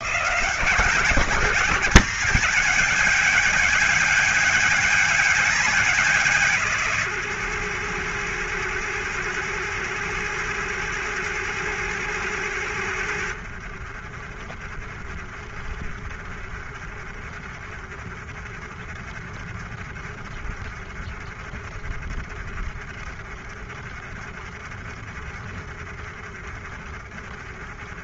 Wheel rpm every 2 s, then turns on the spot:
170, 200, 210, 170, 110, 100, 90, 40, 40, 40, 40, 40, 40, 40.
none